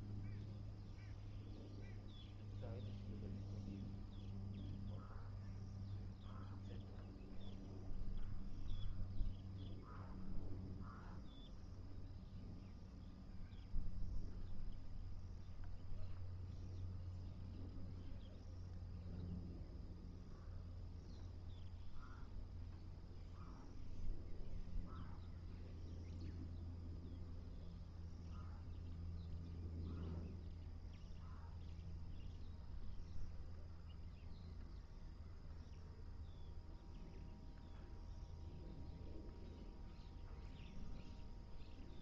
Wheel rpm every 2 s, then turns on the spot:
0, 0, 0, 0, 0, 0, 0, 0, 0, 0, 0, 0, 0, 0, 0, 0, 0, 0, 0, 0, 0.
none